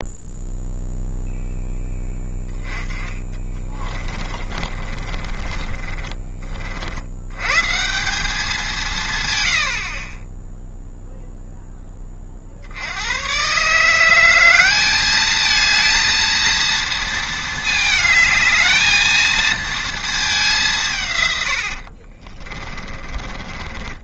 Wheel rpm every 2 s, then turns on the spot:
0, 20, 40, 40, 200, 0, 90, 200, 230, 220, 160, 20.
2-6 22-24